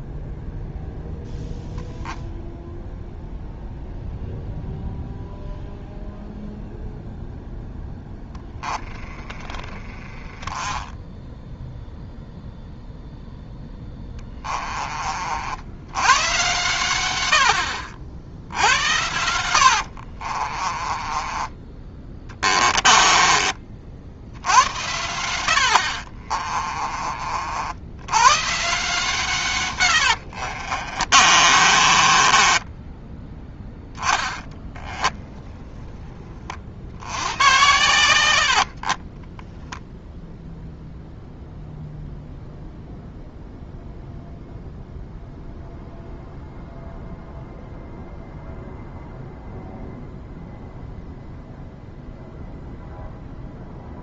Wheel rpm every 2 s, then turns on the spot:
0, 0, 0, 0, 10, 10, 0, 30, 120, 80, 30, 20, 90, 40, 160, 40, 20, 20, 70, 40, 0, 0, 0, 0, 0, 0, 0.
20-24 26-28 30-36 38-40